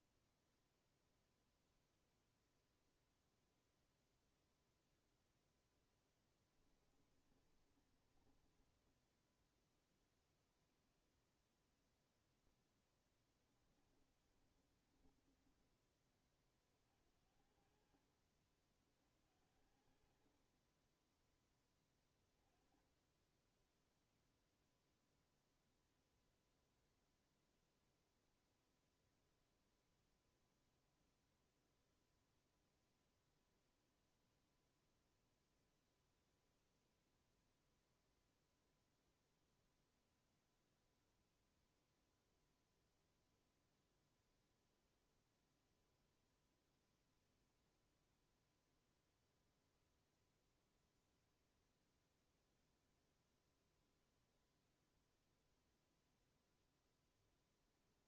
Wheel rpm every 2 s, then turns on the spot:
0, 0, 0, 20, 20, 0, 10, 20, 30, 50, 40, 20, 0, 0, 0, 0, 0, 0, 0, 0, 0, 0, 0, 0, 0, 0, 0, 0, 0.
6-10 14-16